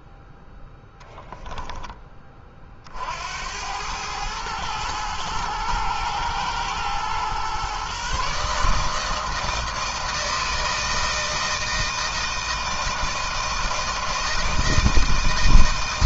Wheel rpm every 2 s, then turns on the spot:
10, 50, 110, 120, 160, 160, 160, 160.
none